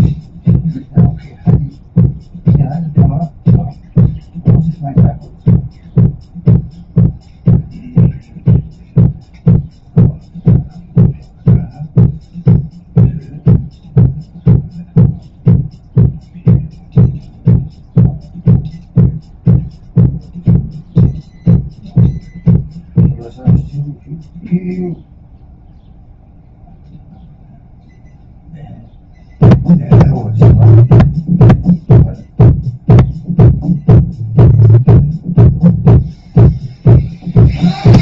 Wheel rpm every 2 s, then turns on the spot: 0, 0, 0, 0, 0, 0, 0, 0, 0, 0, 0, 0, 0, 0, 0, 0, 0, 0, 0.
none